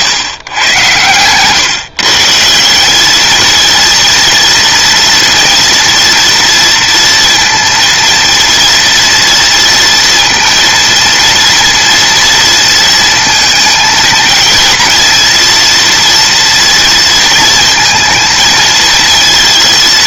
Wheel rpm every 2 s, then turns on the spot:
120, 200, 230, 230, 230, 230, 230, 230, 230, 230.
none